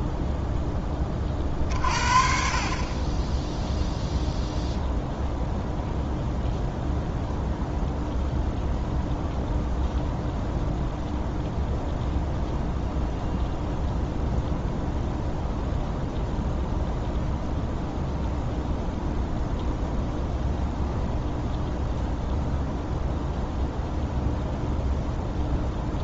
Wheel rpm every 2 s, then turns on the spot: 10, 40, 0, 0, 0, 0, 0, 0, 0, 0, 0, 0, 0.
none